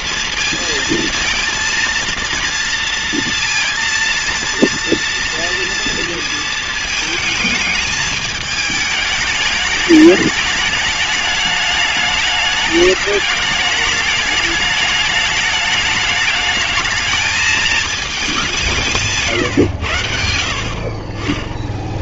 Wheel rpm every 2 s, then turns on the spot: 230, 230, 230, 220, 210, 210, 210, 210, 220, 160, 40.
none